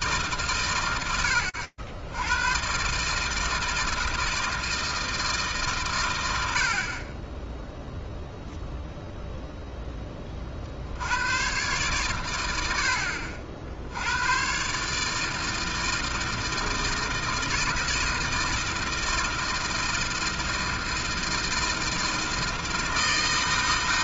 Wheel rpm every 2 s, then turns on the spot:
160, 160, 100, 0, 20, 100, 110, 160, 160, 160, 160, 160.
none